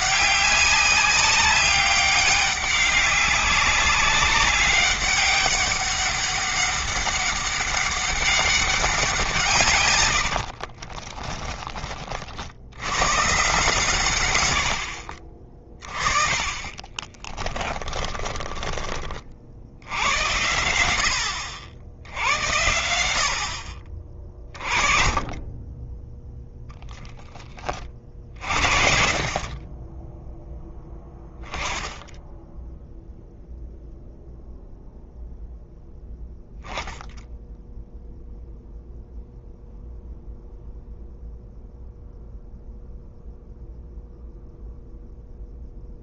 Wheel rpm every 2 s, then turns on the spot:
200, 200, 200, 200, 180, 30, 90, 60, 30, 30, 90, 70, 30, 10, 50, 10, 10, 0, 0, 0, 0, 0, 0.
10-12 16-18